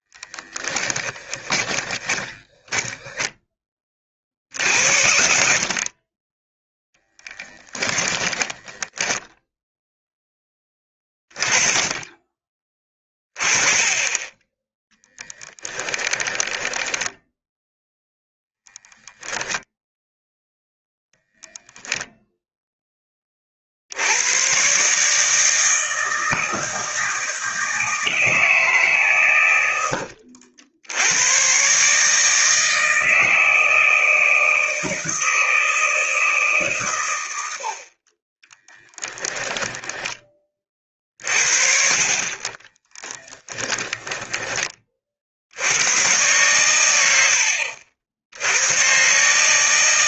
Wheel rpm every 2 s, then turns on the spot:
10, 10, 80, 10, 10, 20, 30, 10, 10, 0, 0, 10, 130, 160, 140, 90, 160, 160, 130, 10, 40, 20, 30, 110, 130.
0-6 8-10 16-18 38-40 42-44